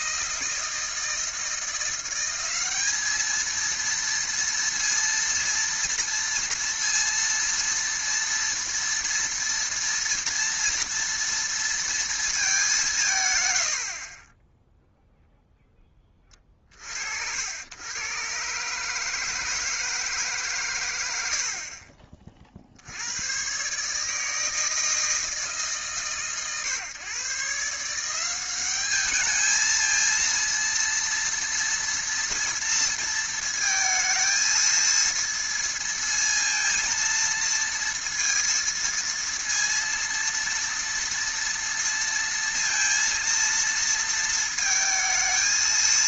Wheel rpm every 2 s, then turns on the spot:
160, 200, 230, 230, 230, 230, 210, 10, 40, 140, 140, 60, 160, 120, 200, 230, 230, 230, 230, 230, 230, 230, 230.
none